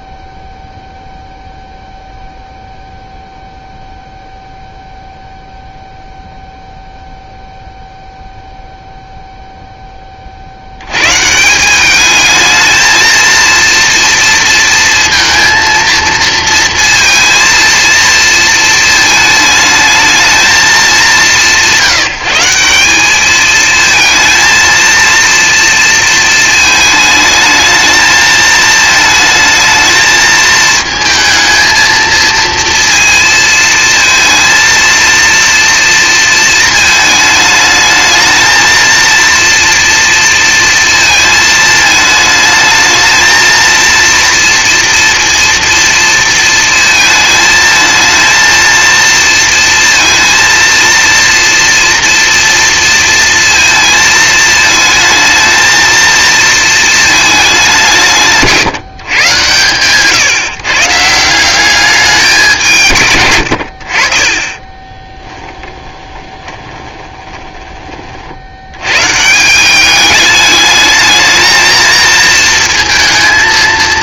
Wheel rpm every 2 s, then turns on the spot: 0, 0, 0, 0, 0, 80, 220, 230, 230, 220, 210, 190, 230, 220, 220, 220, 230, 230, 220, 230, 230, 220, 230, 230, 230, 230, 230, 220, 230, 160, 140, 160, 20, 20, 100, 210, 220.
64-68